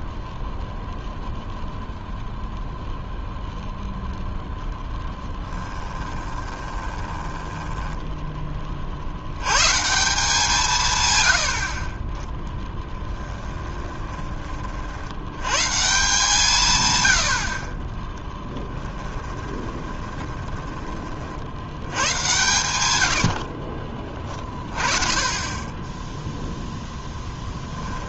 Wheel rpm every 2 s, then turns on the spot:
0, 0, 0, 20, 40, 140, 10, 40, 130, 10, 20, 100, 30, 0.
6-8 12-14 18-22